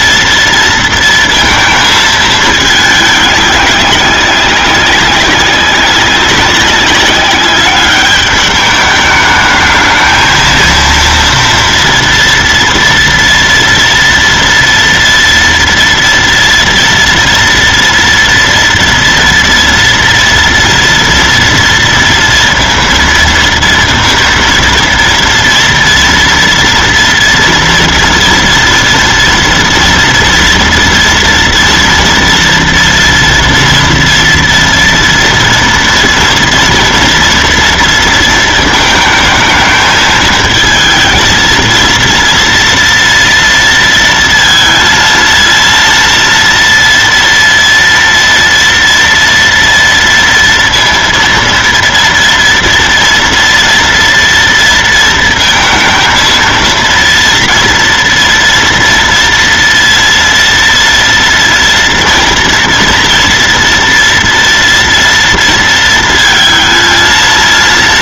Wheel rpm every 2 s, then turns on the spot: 230, 220, 190, 200, 210, 230, 230, 230, 230, 230, 230, 230, 230, 230, 230, 230, 230, 230, 240, 220, 220, 230, 230, 230, 230, 230, 230, 230, 230, 230, 230, 230, 230, 220.
none